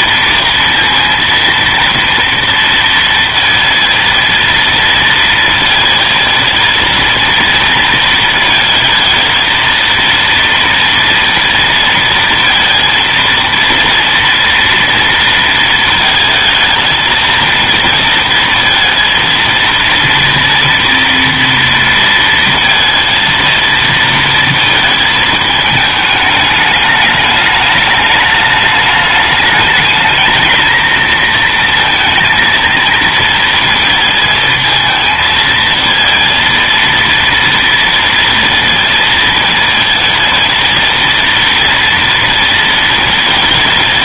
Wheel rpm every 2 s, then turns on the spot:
230, 230, 230, 230, 220, 230, 230, 230, 230, 230, 230, 230, 220, 210, 210, 230, 230, 220, 230, 230, 230, 230.
none